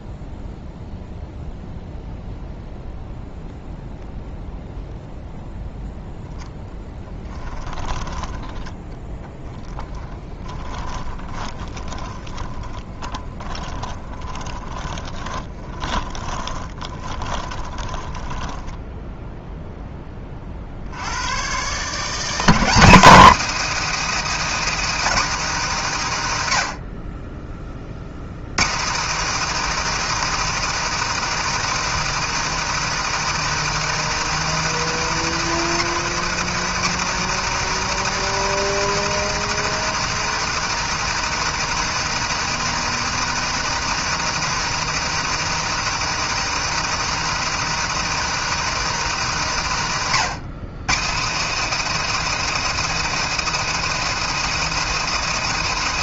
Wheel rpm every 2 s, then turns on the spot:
0, 0, 0, 10, 20, 20, 20, 20, 20, 10, 50, 240, 320, 70, 220, 330, 330, 330, 320, 330, 330, 340, 330, 340, 320, 230, 330, 320.
6-20